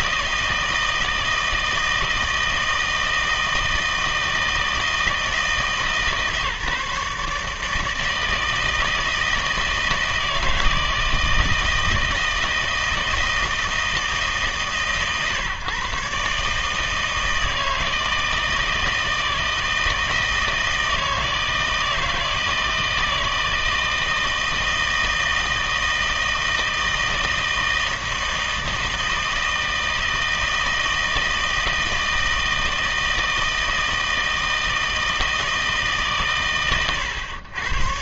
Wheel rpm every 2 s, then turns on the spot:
160, 160, 160, 150, 160, 160, 160, 140, 150, 160, 160, 160, 160, 160, 160, 160, 160, 160, 120.
none